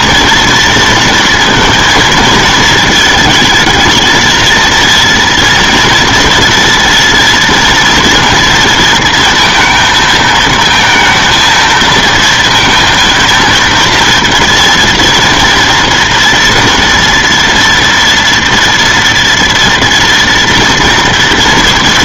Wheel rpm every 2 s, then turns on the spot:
230, 220, 230, 230, 230, 220, 230, 230, 230, 230, 230.
none